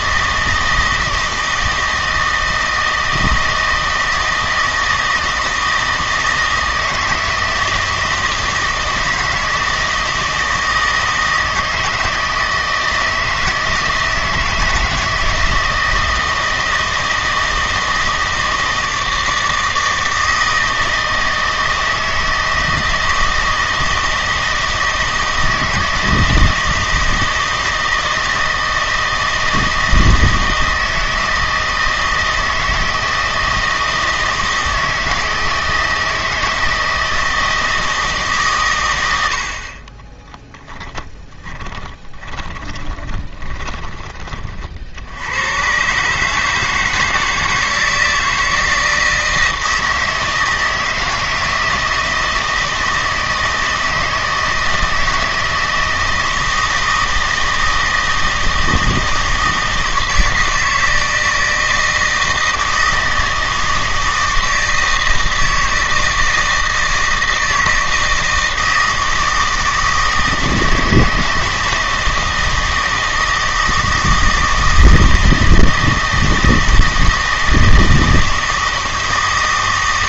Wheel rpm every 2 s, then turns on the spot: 160, 160, 160, 160, 160, 160, 160, 160, 160, 160, 160, 160, 160, 160, 160, 160, 160, 160, 160, 120, 0, 20, 50, 160, 160, 160, 160, 160, 160, 160, 160, 160, 160, 160, 160, 160, 160, 160, 160, 160.
42-44